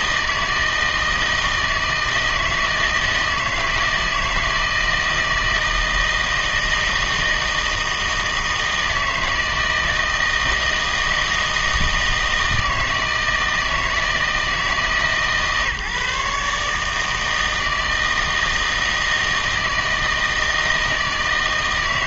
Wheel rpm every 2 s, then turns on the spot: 160, 160, 160, 160, 160, 160, 160, 160, 150, 160, 160.
none